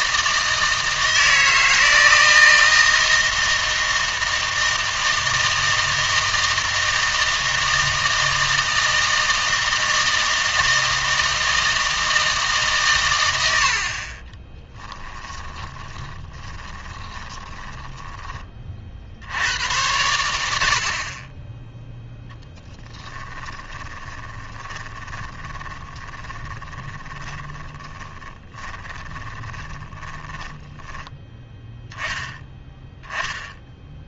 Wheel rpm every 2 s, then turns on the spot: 160, 160, 160, 160, 160, 160, 140, 10, 20, 40, 60, 10, 20, 20, 10, 10, 10.
14-18 22-30